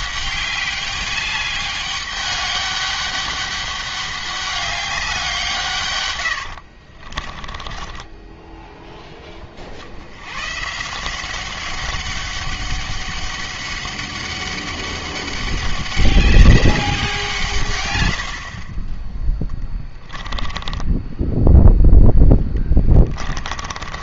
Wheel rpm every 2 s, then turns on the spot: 200, 200, 200, 60, 10, 150, 200, 200, 190, 20, 10, 20.
6-8 20-24